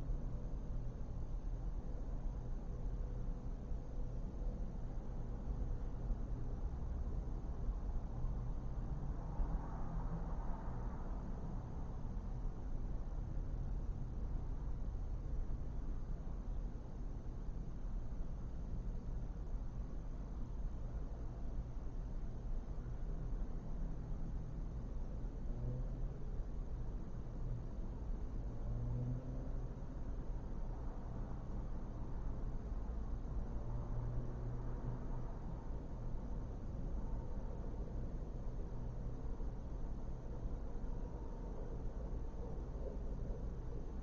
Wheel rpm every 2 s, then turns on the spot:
0, 0, 0, 0, 0, 0, 0, 0, 0, 0, 0, 0, 0, 0, 0, 0, 0, 0, 0, 0, 0, 0.
none